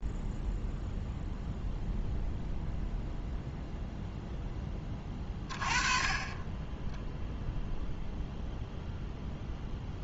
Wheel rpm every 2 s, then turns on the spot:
0, 0, 10, 10, 0.
none